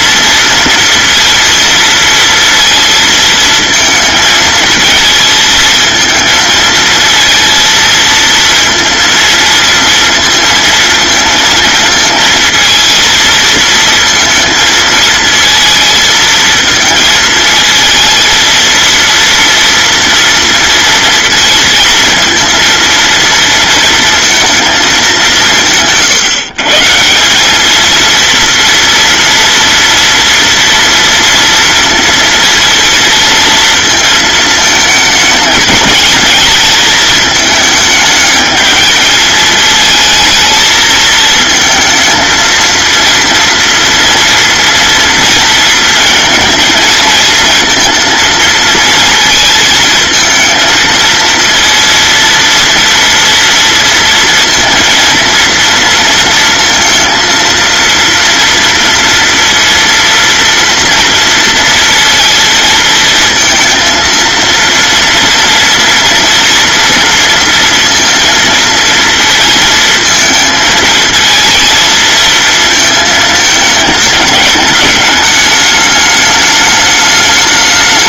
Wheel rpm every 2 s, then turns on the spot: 230, 230, 230, 230, 230, 230, 230, 230, 220, 230, 230, 230, 200, 170, 230, 230, 230, 220, 220, 220, 220, 230, 230, 230, 230, 230, 230, 230, 230, 230, 230, 230, 230, 230, 230, 220, 220, 210, 220.
none